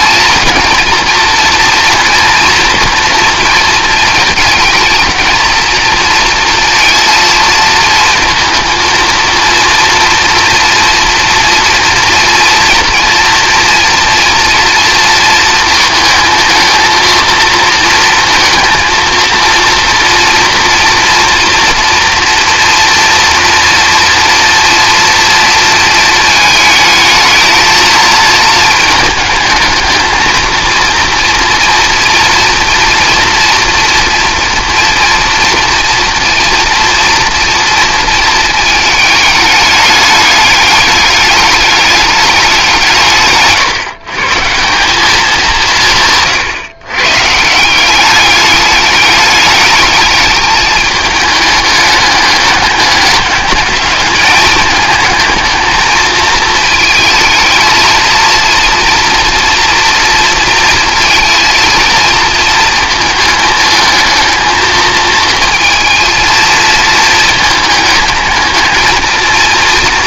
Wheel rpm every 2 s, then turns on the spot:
230, 230, 220, 230, 230, 230, 230, 230, 220, 230, 230, 230, 230, 220, 220, 230, 240, 230, 240, 220, 210, 180, 170, 130, 200, 210, 200, 210, 220, 240, 230, 220, 220, 230, 220.
none